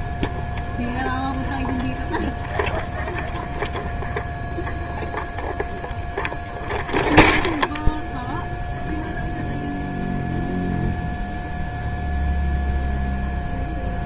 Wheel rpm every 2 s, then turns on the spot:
0, 0, 0, 0, 0, 0, 0.
none